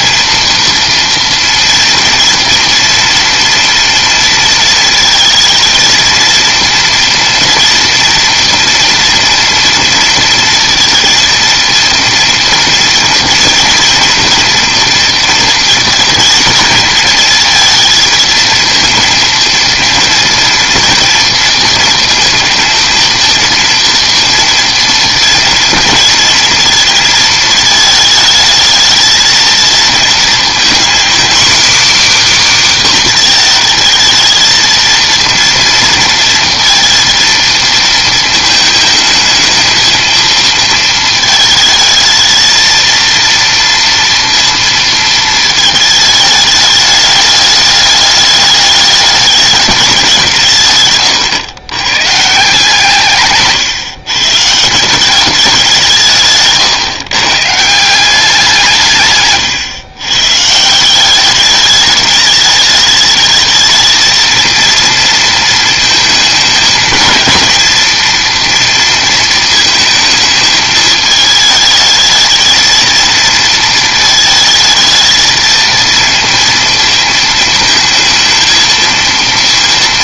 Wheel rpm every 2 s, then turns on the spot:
230, 230, 230, 230, 230, 230, 230, 230, 220, 230, 230, 230, 230, 230, 220, 240, 280, 230, 230, 220, 220, 220, 230, 210, 210, 150, 160, 160, 140, 180, 150, 210, 230, 220, 230, 220, 220, 220, 230, 230.
none